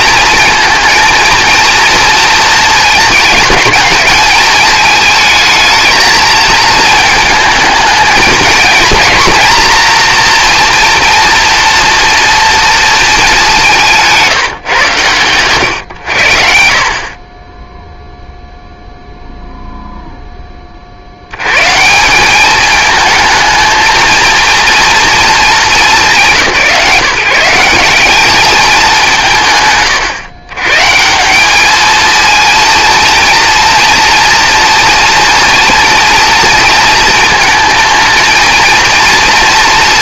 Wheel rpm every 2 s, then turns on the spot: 230, 230, 210, 220, 230, 240, 230, 180, 90, 0, 30, 210, 230, 170, 200, 140, 230, 230, 230, 230.
none